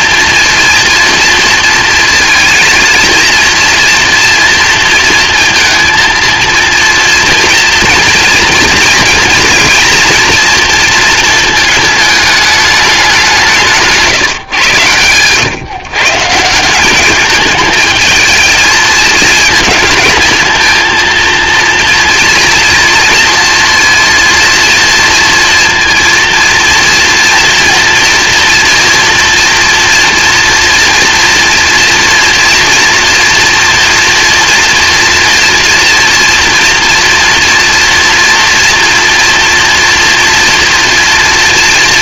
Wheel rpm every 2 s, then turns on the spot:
230, 230, 230, 230, 230, 230, 210, 120, 170, 220, 220, 230, 230, 230, 230, 230, 230, 230, 230, 230, 230.
none